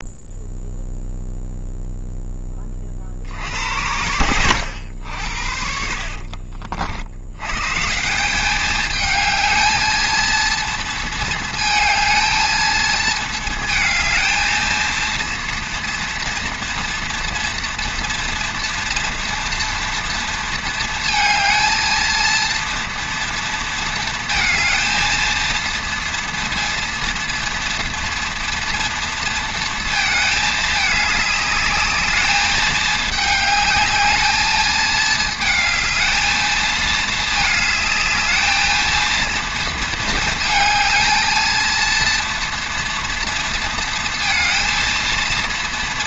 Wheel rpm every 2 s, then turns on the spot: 0, 30, 90, 50, 210, 230, 220, 220, 230, 230, 230, 230, 220, 230, 230, 210, 210, 220, 220, 220, 220, 240, 230.
4-6